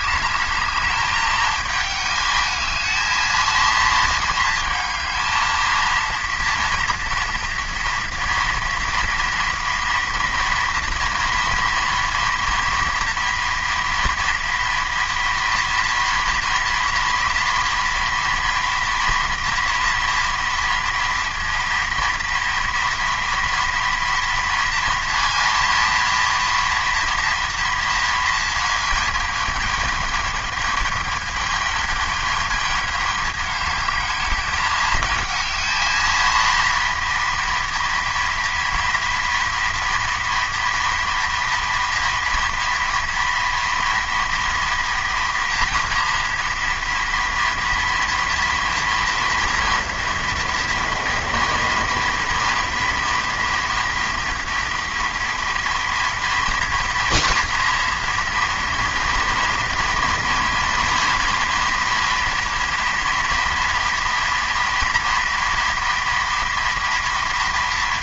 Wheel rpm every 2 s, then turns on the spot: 210, 210, 220, 230, 230, 230, 230, 240, 230, 230, 230, 230, 230, 230, 230, 210, 220, 220, 230, 230, 230, 230, 230, 230, 230, 230, 230, 230, 230, 240, 230, 230, 240, 240.
none